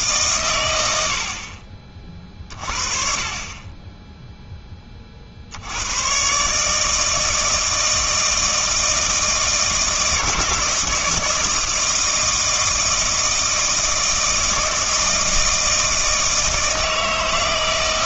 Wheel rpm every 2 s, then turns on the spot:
110, 30, 20, 150, 160, 160, 160, 160, 160.
none